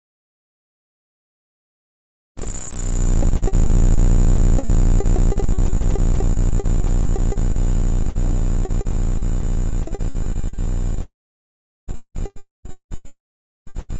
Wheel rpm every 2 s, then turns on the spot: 0, 0, 0, 0, 0, 0, 0.
none